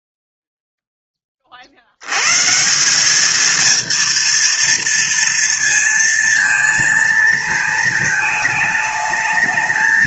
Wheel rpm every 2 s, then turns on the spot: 0, 160, 230, 230, 210.
none